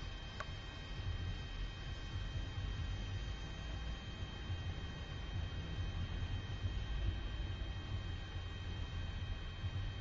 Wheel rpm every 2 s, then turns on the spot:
0, 0, 0, 0, 0.
none